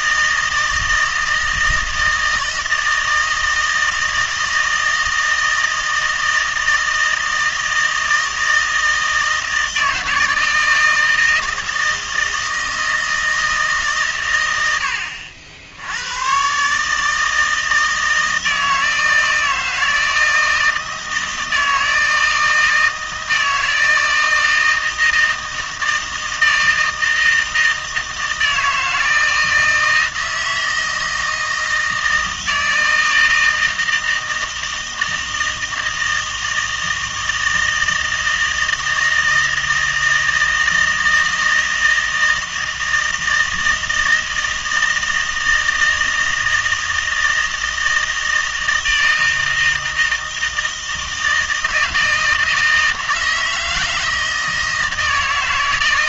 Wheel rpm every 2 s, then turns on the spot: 160, 160, 160, 160, 160, 160, 160, 90, 140, 160, 160, 160, 160, 160, 160, 160, 160, 160, 160, 160, 160, 160, 160, 160, 160, 160, 160, 160.
none